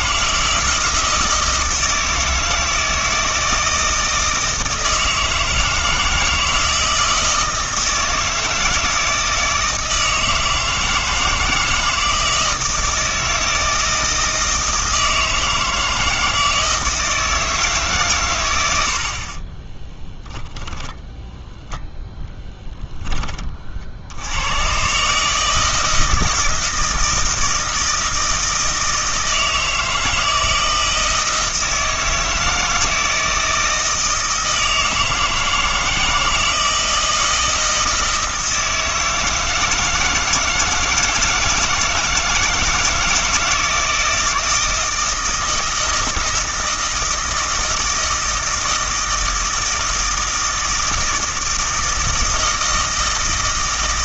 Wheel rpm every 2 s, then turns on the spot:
160, 160, 160, 160, 160, 160, 160, 160, 160, 100, 10, 0, 110, 160, 160, 160, 160, 160, 160, 160, 160, 160, 160, 160, 160, 160, 160.
20-22